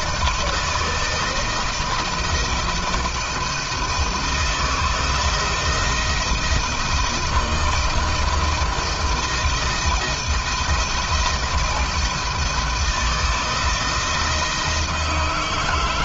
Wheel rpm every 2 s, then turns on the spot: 170, 160, 160, 170, 160, 160, 160, 160.
none